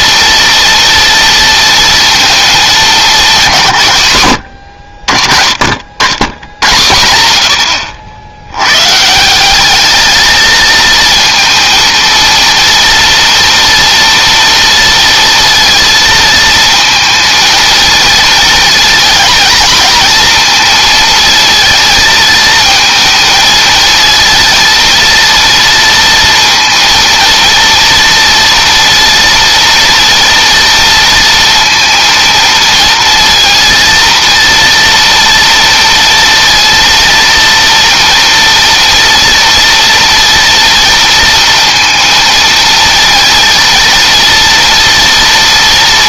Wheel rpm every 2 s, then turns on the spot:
230, 210, 60, 110, 140, 220, 230, 230, 220, 230, 220, 220, 230, 230, 230, 230, 230, 230, 230, 230, 230, 230, 230.
none